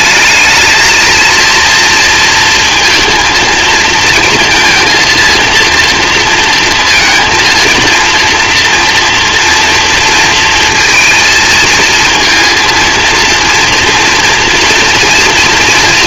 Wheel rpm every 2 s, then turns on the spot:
220, 230, 230, 230, 230, 230, 230, 230.
none